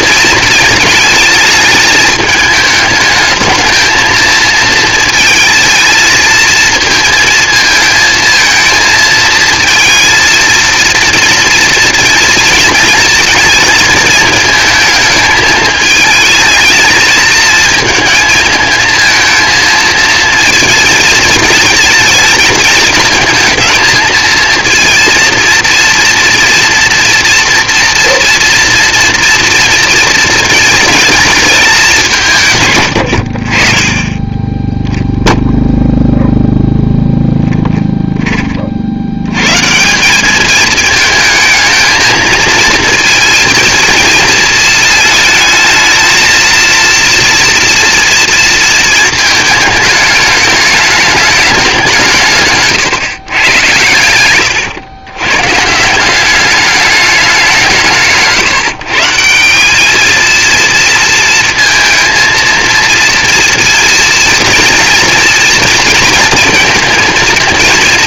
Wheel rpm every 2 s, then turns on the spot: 220, 210, 230, 230, 220, 230, 230, 220, 220, 220, 230, 220, 230, 240, 230, 220, 130, 10, 0, 40, 220, 220, 220, 230, 230, 220, 140, 110, 200, 150, 230, 230, 230, 230.
52-54